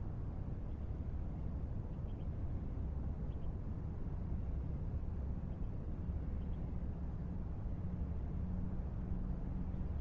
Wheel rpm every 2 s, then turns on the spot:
0, 0, 0, 0, 0.
none